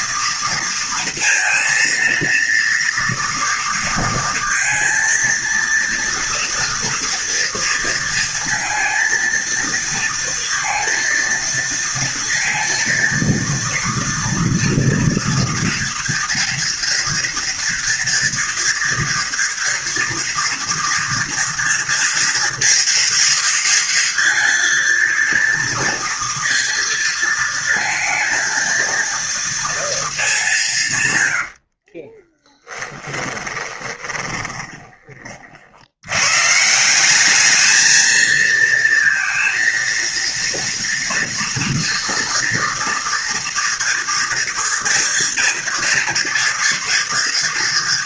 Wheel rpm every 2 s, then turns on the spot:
230, 230, 230, 230, 230, 230, 230, 230, 230, 230, 230, 230, 230, 230, 230, 170, 20, 20, 160, 230, 230, 230, 230, 240.
32-36